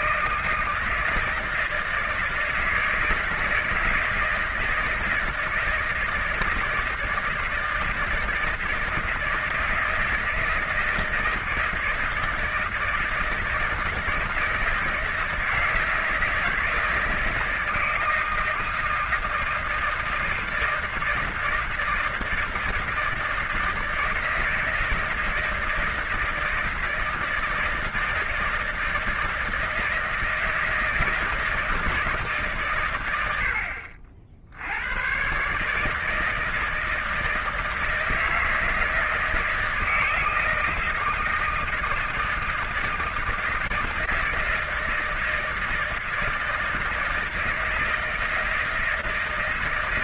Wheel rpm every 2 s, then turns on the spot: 160, 160, 160, 160, 160, 160, 160, 160, 160, 160, 160, 160, 160, 160, 160, 160, 140, 70, 160, 160, 160, 160, 160, 160, 160.
none